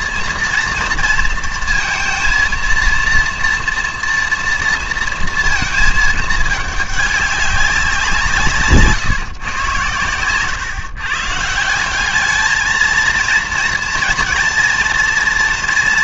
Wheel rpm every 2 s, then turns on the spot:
230, 230, 230, 210, 140, 130, 220, 230.
none